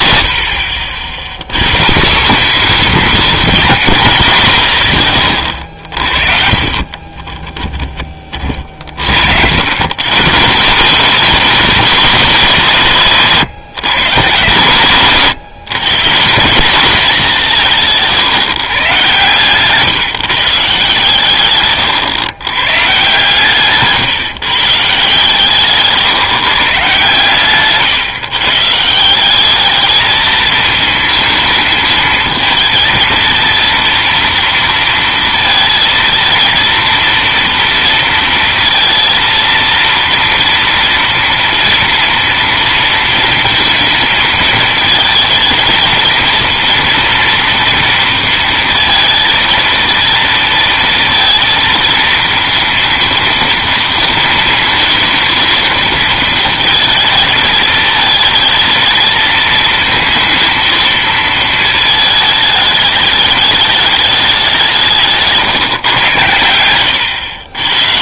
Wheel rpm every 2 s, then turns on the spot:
30, 230, 150, 40, 50, 150, 170, 130, 190, 140, 150, 140, 150, 150, 140, 220, 220, 230, 230, 230, 230, 230, 220, 230, 230, 230, 230, 230, 220, 220, 220, 210, 190, 100.
6-10